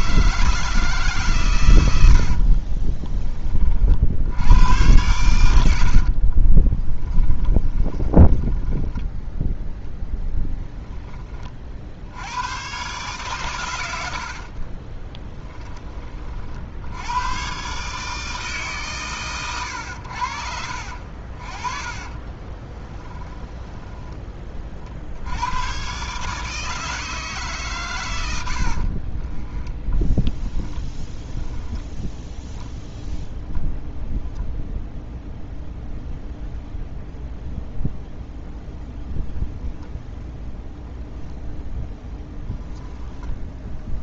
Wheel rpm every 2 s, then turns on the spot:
160, 40, 90, 20, 10, 10, 120, 30, 70, 140, 60, 20, 40, 150, 60, 10, 10, 0, 0, 10, 0, 10.
2-4 6-10 14-16 22-24 28-32